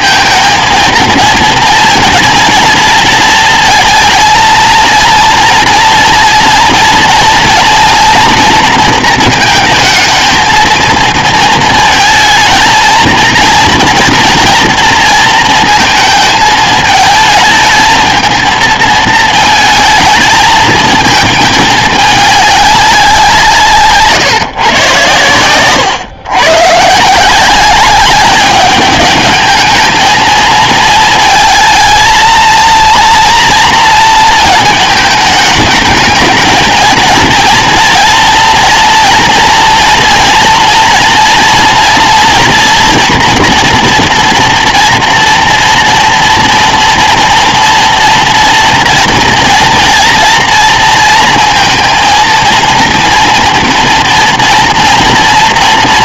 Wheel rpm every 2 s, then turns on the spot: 230, 230, 230, 240, 230, 230, 220, 230, 220, 220, 220, 200, 140, 120, 210, 230, 230, 220, 230, 240, 240, 240, 230, 240, 230, 230, 230, 240.
none